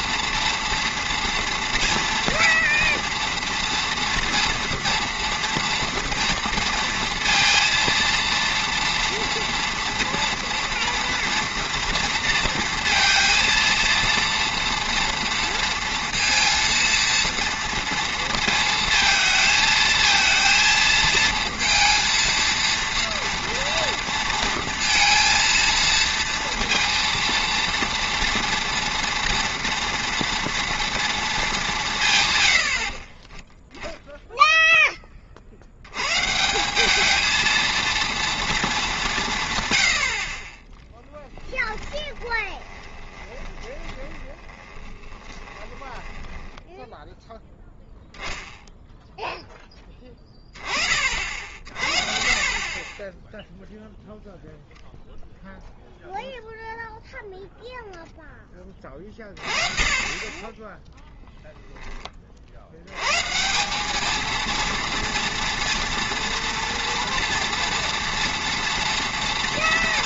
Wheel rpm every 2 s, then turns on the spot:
230, 230, 230, 230, 240, 230, 230, 230, 230, 230, 230, 230, 230, 230, 240, 230, 80, 10, 180, 220, 20, 20, 30, 10, 0, 30, 30, 0, 0, 20, 10, 70, 230, 230, 230.
42-48